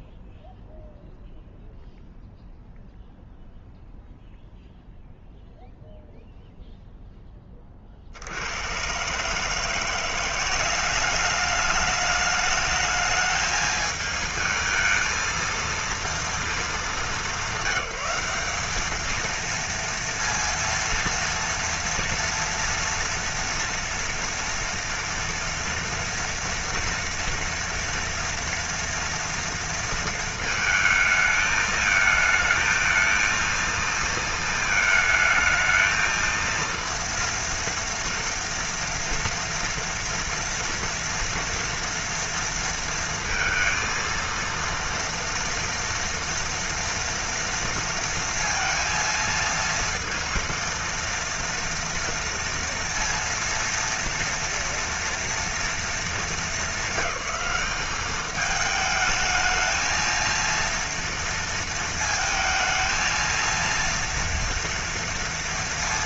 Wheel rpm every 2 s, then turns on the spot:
0, 0, 0, 0, 110, 190, 210, 220, 200, 220, 230, 230, 230, 230, 230, 220, 220, 220, 230, 230, 230, 230, 230, 230, 230, 230, 230, 230, 210, 210, 230, 230, 230.
none